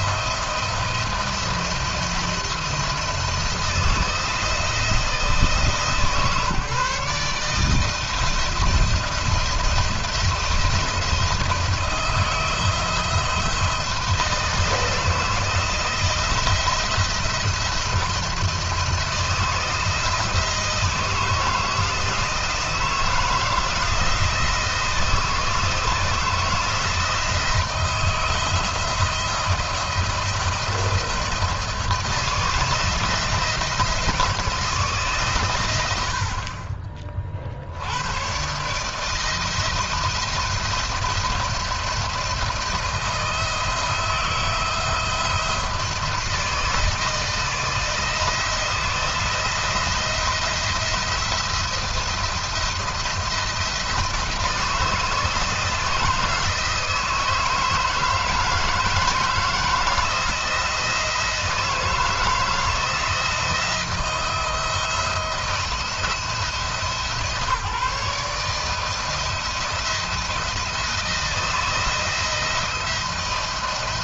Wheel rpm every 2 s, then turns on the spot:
170, 170, 160, 150, 170, 170, 160, 170, 170, 170, 160, 160, 160, 160, 160, 170, 160, 160, 50, 130, 170, 170, 170, 160, 160, 170, 170, 160, 160, 160, 160, 160, 170, 160, 160, 170, 170.
none